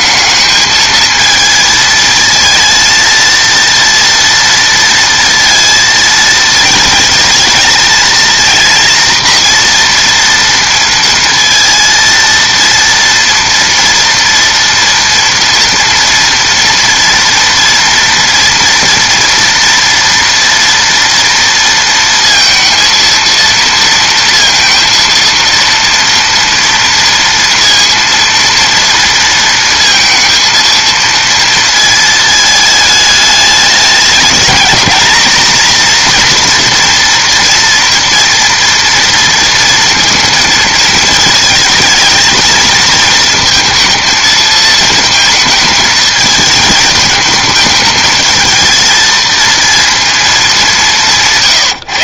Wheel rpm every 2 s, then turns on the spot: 220, 220, 230, 220, 230, 230, 230, 230, 230, 230, 230, 230, 230, 230, 230, 230, 220, 230, 240, 230, 220, 220, 220, 220, 220, 190.
none